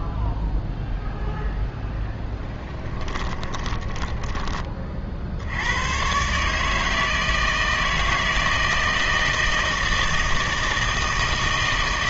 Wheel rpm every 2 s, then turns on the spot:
0, 10, 30, 150, 160, 160.
2-4